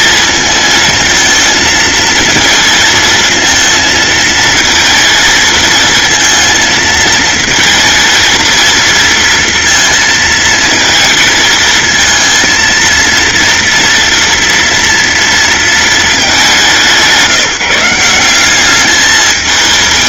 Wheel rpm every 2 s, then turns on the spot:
230, 230, 230, 220, 230, 220, 230, 230, 180, 210.
none